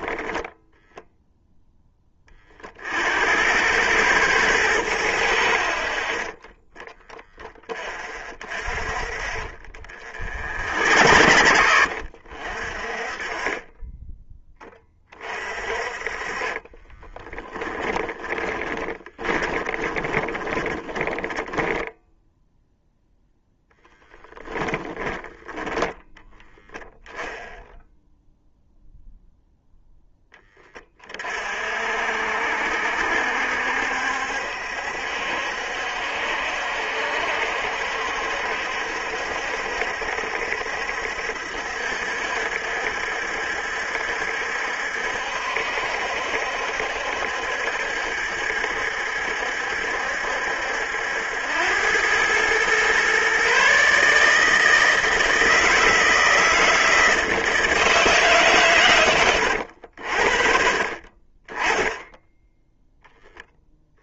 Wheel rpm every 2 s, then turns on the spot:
0, 50, 100, 10, 50, 70, 40, 20, 30, 20, 20, 0, 10, 0, 0, 30, 70, 70, 70, 70, 70, 70, 70, 70, 70, 80, 130, 160, 160, 110, 40, 10.
8-12 16-22 24-26